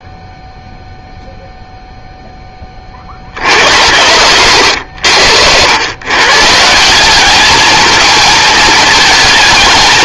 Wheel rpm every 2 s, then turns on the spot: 0, 30, 80, 180, 220.
none